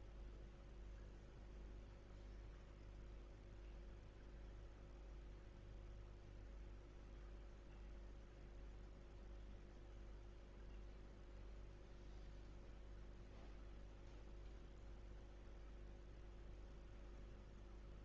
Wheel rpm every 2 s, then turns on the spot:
0, 0, 0, 0, 0, 0, 0, 0, 0.
none